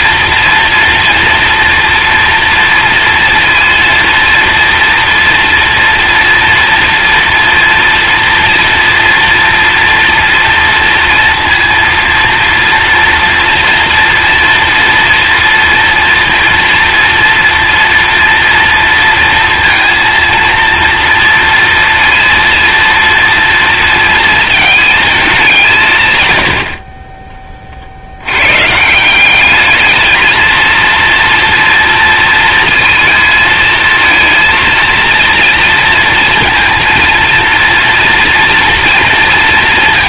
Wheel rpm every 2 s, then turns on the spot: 230, 230, 230, 230, 230, 230, 230, 230, 230, 240, 230, 230, 220, 40, 150, 230, 220, 230, 230, 230.
26-28